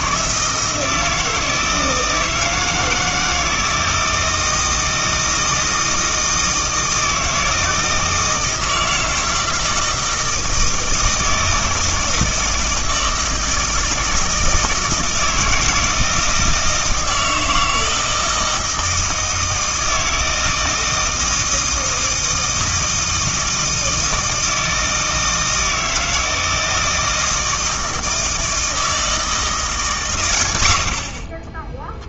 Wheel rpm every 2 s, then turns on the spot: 160, 160, 160, 160, 160, 160, 160, 160, 160, 160, 160, 160, 160, 160, 160, 90.
none